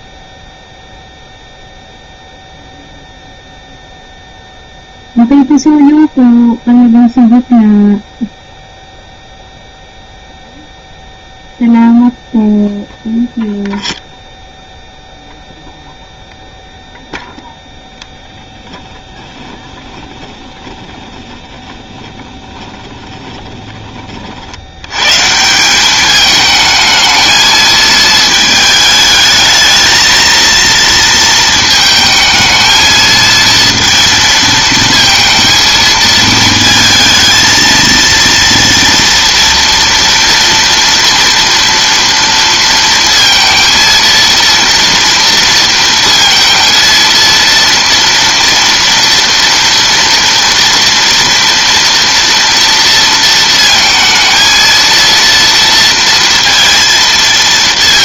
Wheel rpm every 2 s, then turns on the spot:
0, 0, 0, 0, 0, 0, 0, 0, 0, 10, 10, 20, 70, 220, 220, 230, 220, 230, 220, 230, 230, 230, 230, 230, 230, 230, 230, 230, 230.
18-24